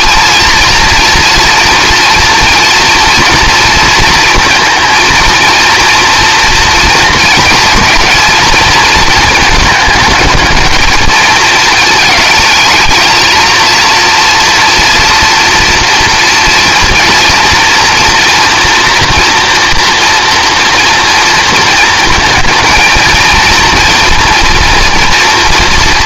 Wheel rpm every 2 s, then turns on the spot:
230, 230, 230, 230, 230, 210, 220, 230, 230, 230, 230, 220, 240.
none